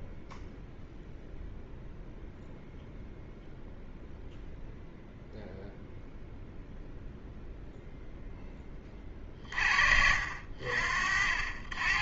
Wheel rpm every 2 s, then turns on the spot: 0, 0, 0, 0, 20, 50.
none